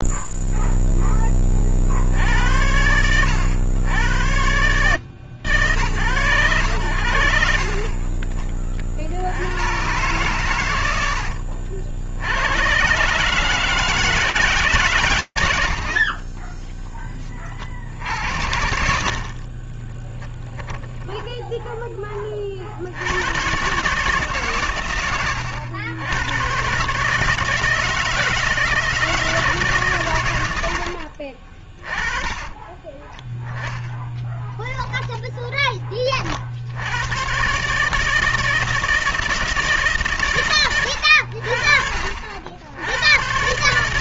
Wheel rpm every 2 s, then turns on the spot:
0, 30, 100, 120, 40, 120, 70, 150, 50, 70, 10, 30, 140, 110, 160, 90, 20, 10, 40, 160, 100, 70.
20-22 32-36